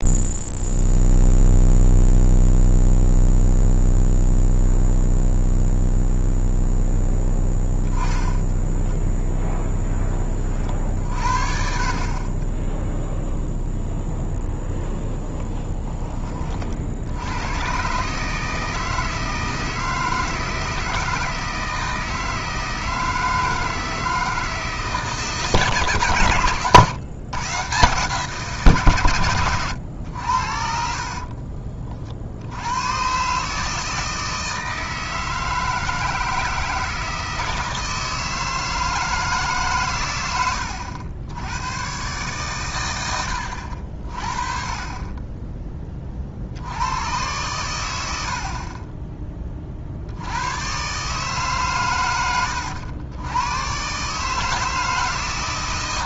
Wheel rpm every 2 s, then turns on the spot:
0, 0, 0, 0, 0, 50, 0, 0, 70, 160, 160, 160, 150, 120, 120, 50, 110, 160, 160, 160, 80, 110, 30, 100, 20, 130, 90, 160.
30-32